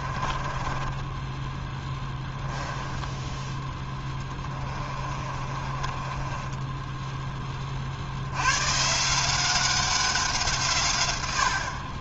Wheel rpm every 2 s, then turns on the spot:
10, 10, 30, 10, 150, 120.
0-2 4-8